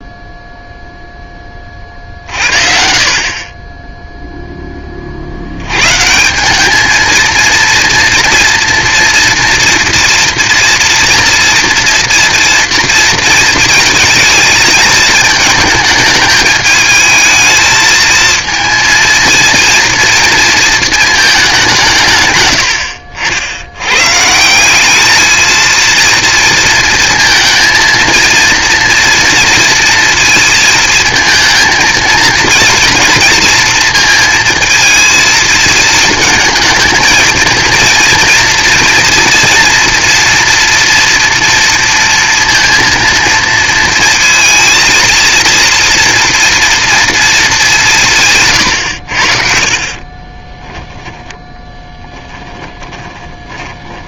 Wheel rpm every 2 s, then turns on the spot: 0, 40, 30, 220, 230, 230, 230, 220, 220, 230, 220, 70, 210, 230, 240, 220, 230, 230, 220, 230, 230, 230, 230, 230, 90, 10, 30.
50-54